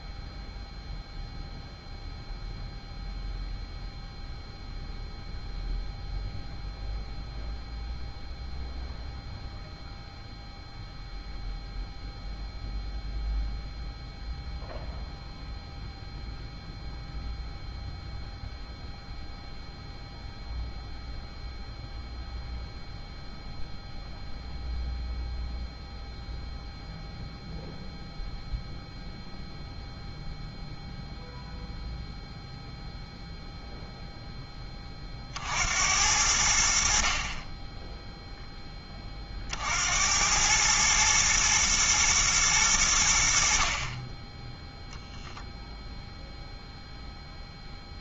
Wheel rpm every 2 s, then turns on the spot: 0, 0, 0, 0, 0, 0, 0, 0, 0, 0, 0, 0, 0, 0, 0, 0, 0, 20, 60, 10, 110, 100, 0, 0.
none